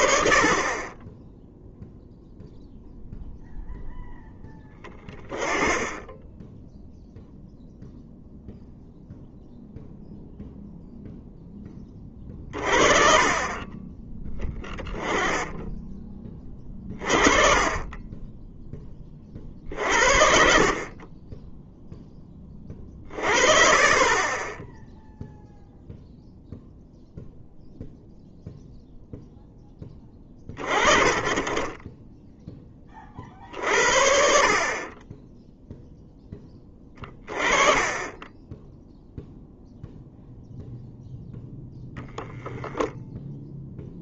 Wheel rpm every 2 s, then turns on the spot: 20, 0, 20, 0, 0, 0, 30, 10, 30, 20, 30, 40, 10, 0, 0, 30, 30, 30, 20, 0, 0, 0.
none